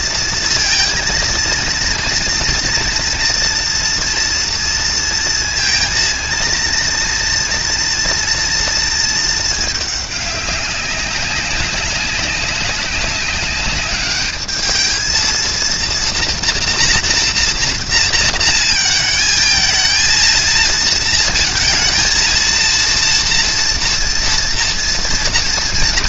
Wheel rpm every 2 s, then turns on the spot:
230, 230, 230, 230, 230, 200, 200, 220, 230, 230, 230, 230, 240.
none